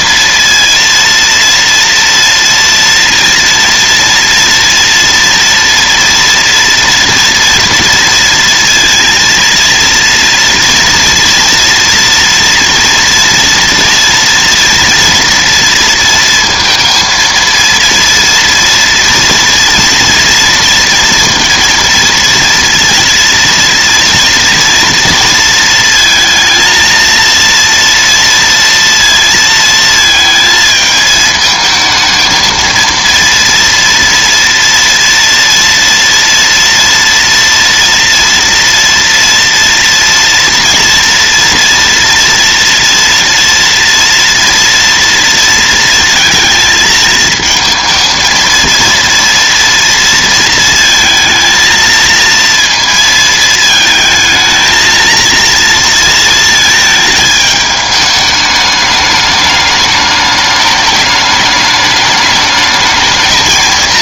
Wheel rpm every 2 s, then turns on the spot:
230, 230, 230, 230, 230, 230, 230, 230, 230, 230, 230, 230, 230, 230, 230, 220, 220, 230, 230, 230, 230, 230, 230, 220, 230, 230, 230, 220, 220, 210, 210, 210.
none